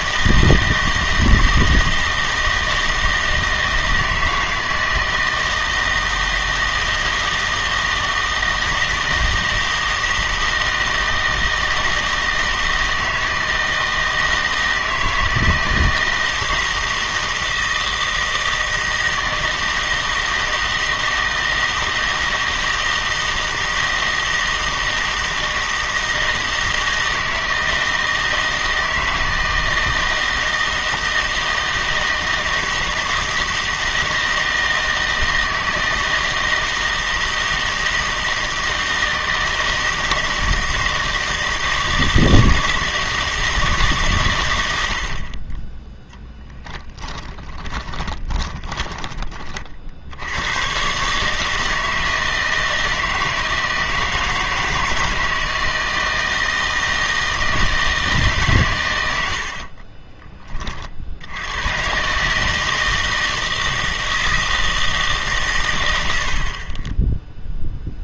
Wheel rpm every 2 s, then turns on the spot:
160, 160, 160, 160, 160, 160, 160, 160, 160, 160, 160, 160, 160, 160, 160, 160, 160, 160, 160, 160, 160, 160, 90, 20, 20, 120, 160, 160, 160, 110, 40, 160, 160, 30.
46-50